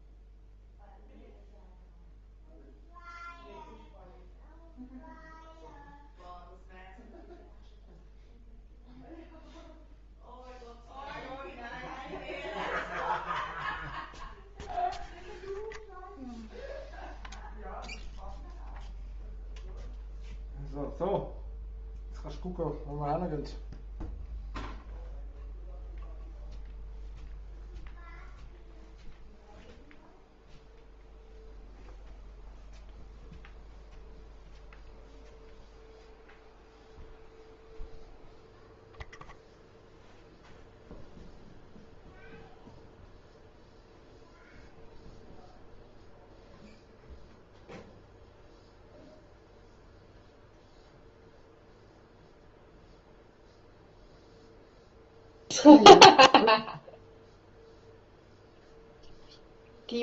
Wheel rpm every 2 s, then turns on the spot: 0, 0, 0, 0, 0, 0, 0, 0, 0, 0, 0, 0, 0, 0, 0, 0, 0, 0, 0, 0, 0, 0, 0, 0, 0, 0, 0, 0, 0, 0.
none